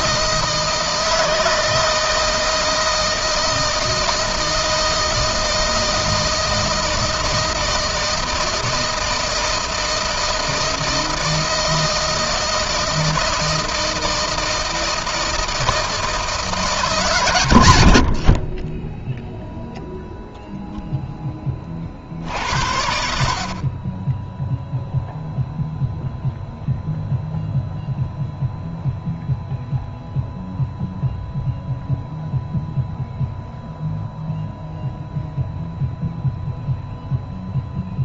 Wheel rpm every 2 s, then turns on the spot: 160, 160, 160, 160, 160, 160, 160, 160, 140, 10, 0, 60, 0, 0, 0, 0, 0, 0, 0.
none